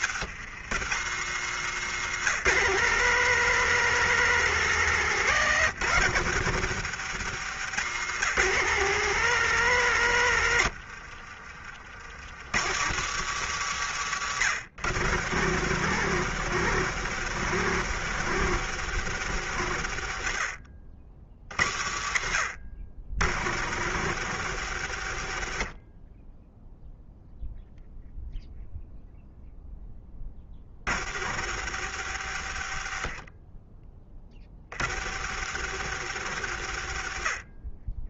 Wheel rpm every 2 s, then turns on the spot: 100, 170, 170, 110, 170, 60, 130, 110, 140, 120, 50, 70, 90, 0, 0, 80, 50, 80, 60.
10-12